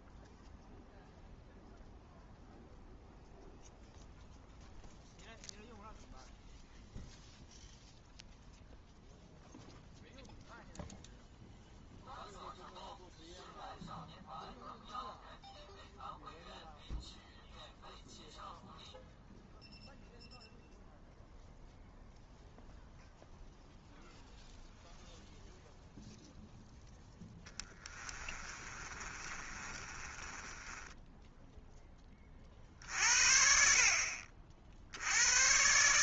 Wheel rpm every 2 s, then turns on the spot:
0, 0, 0, 0, 0, 0, 0, 0, 0, 0, 0, 0, 0, 10, 30, 10, 50, 60.
28-32